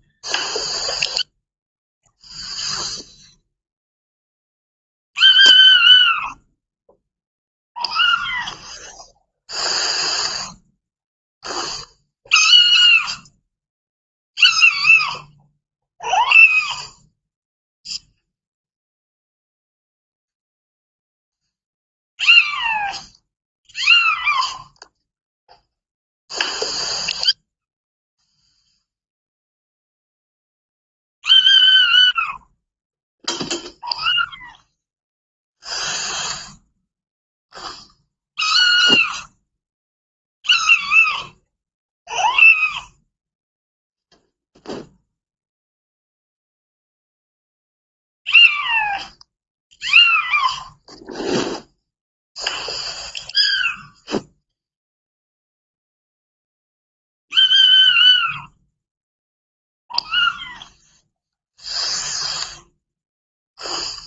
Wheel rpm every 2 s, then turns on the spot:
0, 0, 0, 0, 0, 0, 0, 0, 0, 0, 0, 0, 0, 0, 0, 0, 0, 0, 0, 0, 0, 0, 0, 0, 0, 0, 0, 0, 0, 0, 0, 0.
none